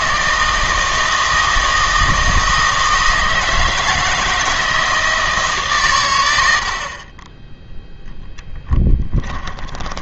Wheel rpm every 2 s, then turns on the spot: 160, 160, 160, 60, 10.
8-10